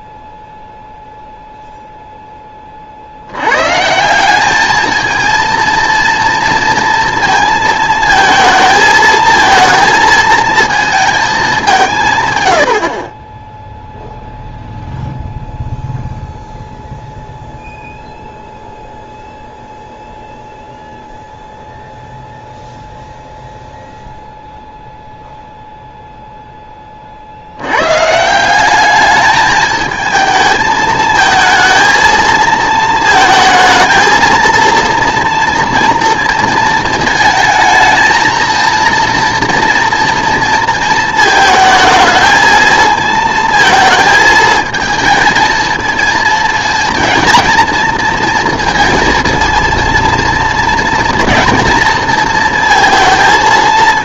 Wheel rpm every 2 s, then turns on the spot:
0, 40, 210, 230, 220, 230, 80, 0, 0, 0, 0, 0, 0, 10, 190, 220, 230, 230, 220, 230, 230, 220, 220, 230, 230, 230, 230.
none